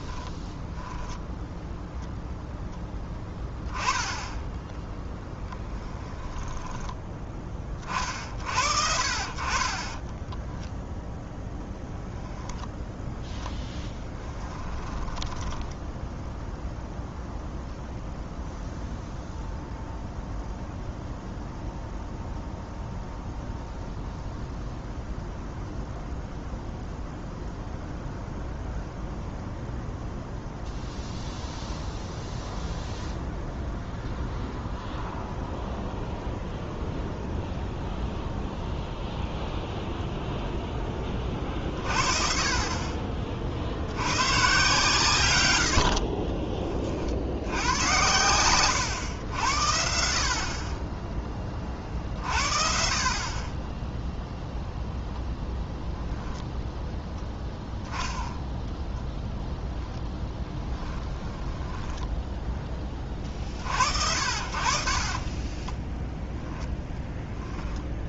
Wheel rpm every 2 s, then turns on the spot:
0, 0, 10, 20, 50, 0, 10, 10, 0, 0, 0, 0, 0, 0, 0, 0, 0, 0, 0, 0, 0, 40, 130, 40, 100, 30, 50, 0, 10, 0, 10, 10, 50, 10.
6-8 14-16 60-62